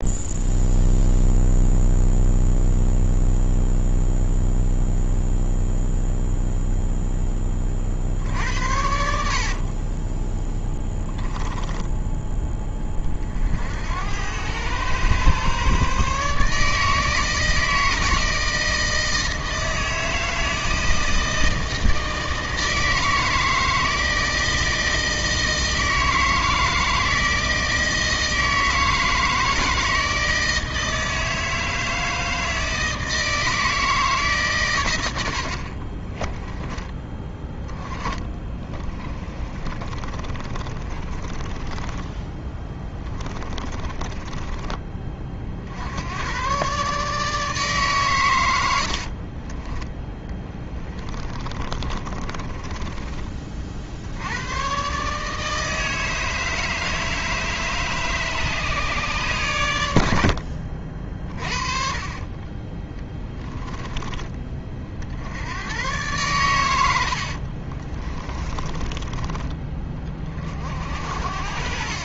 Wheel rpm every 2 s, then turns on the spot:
0, 0, 0, 0, 70, 10, 20, 110, 160, 160, 160, 160, 160, 160, 160, 160, 160, 110, 20, 20, 30, 20, 30, 130, 80, 10, 30, 120, 160, 150, 50, 30, 50, 110, 20, 60.
38-44 48-54 66-70